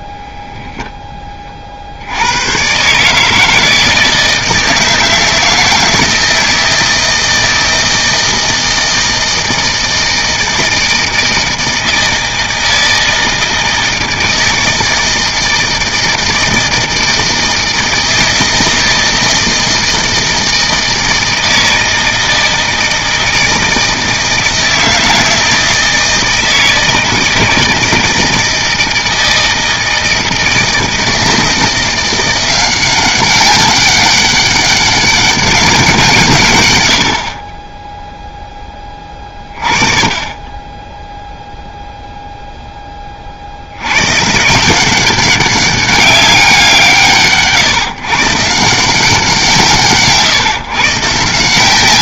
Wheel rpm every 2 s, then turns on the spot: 0, 130, 160, 160, 160, 160, 160, 160, 160, 160, 160, 160, 160, 160, 160, 160, 180, 200, 100, 10, 10, 10, 170, 170, 170, 140.
none